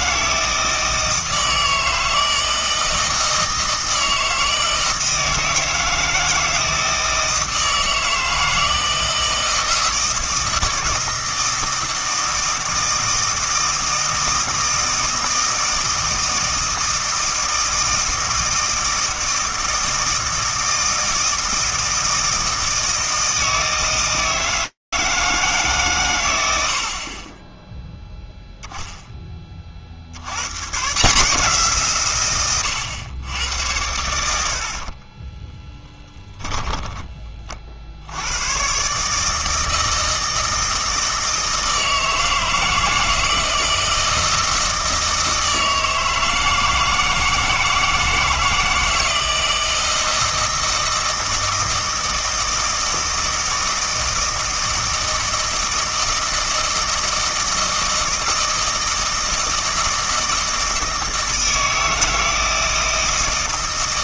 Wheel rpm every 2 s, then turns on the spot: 160, 160, 160, 160, 160, 160, 160, 160, 160, 160, 160, 160, 160, 70, 10, 130, 110, 50, 20, 130, 160, 160, 160, 160, 160, 160, 160, 160, 160, 160, 160, 160.
36-38